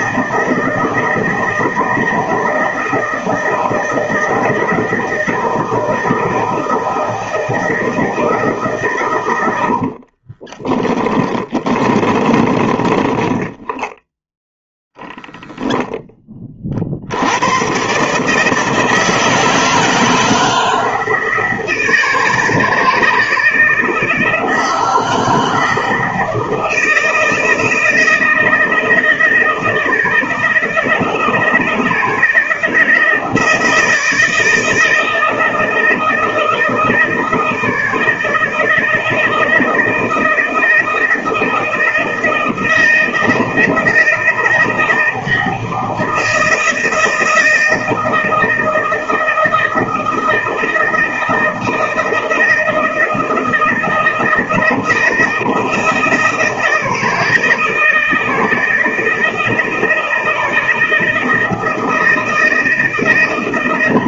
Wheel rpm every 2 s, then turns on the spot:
160, 160, 160, 160, 140, 20, 10, 0, 40, 160, 160, 160, 160, 160, 160, 160, 160, 160, 160, 160, 160, 160, 160, 170, 160, 160, 160, 160, 160, 160, 160, 160.
10-14